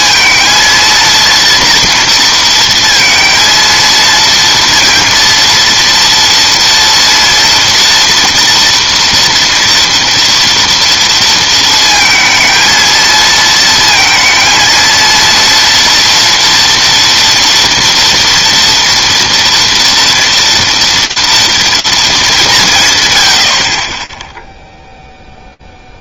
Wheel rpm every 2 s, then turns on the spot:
230, 230, 230, 230, 230, 230, 230, 230, 230, 240, 230, 110, 0.
none